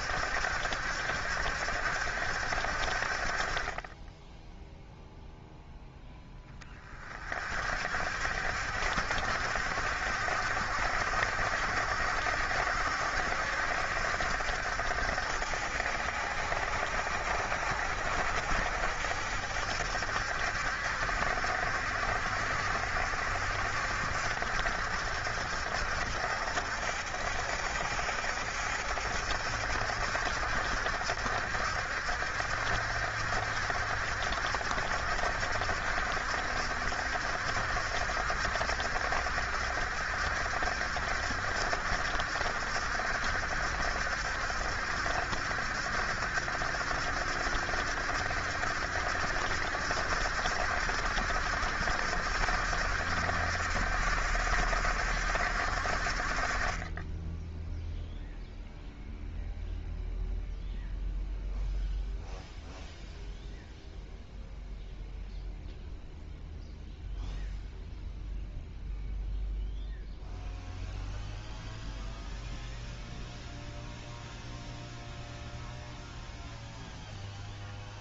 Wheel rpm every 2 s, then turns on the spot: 70, 60, 0, 20, 60, 70, 70, 60, 70, 70, 70, 70, 70, 70, 70, 70, 70, 70, 70, 70, 70, 70, 70, 70, 70, 70, 70, 70, 30, 0, 0, 0, 0, 0, 0, 0, 0, 0, 0.
none